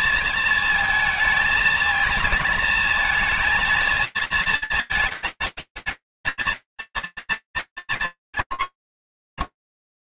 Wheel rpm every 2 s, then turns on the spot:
230, 230, 230, 220, 250.
none